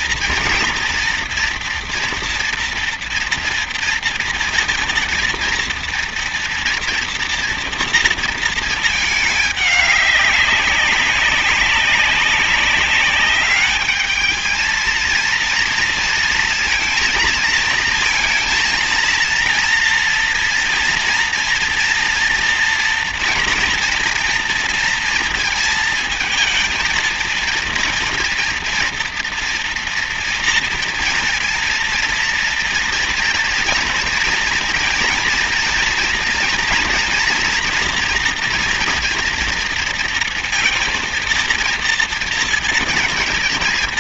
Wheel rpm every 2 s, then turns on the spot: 240, 230, 230, 240, 220, 200, 200, 230, 230, 230, 230, 230, 230, 230, 230, 230, 230, 230, 230, 240, 230, 230.
none